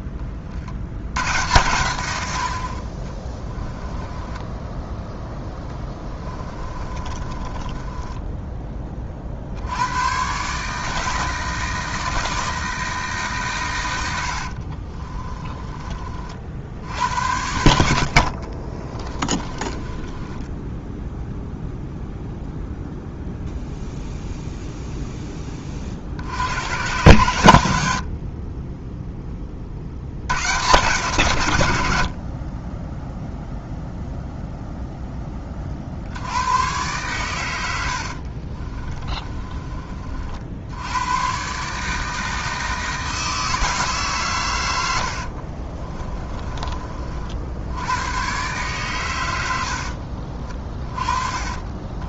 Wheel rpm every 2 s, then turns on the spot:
80, 50, 10, 30, 20, 150, 160, 50, 70, 30, 10, 0, 0, 90, 10, 130, 20, 10, 120, 40, 90, 160, 100, 30, 120, 30.
4-8 14-16 18-22 28-30 38-40 44-46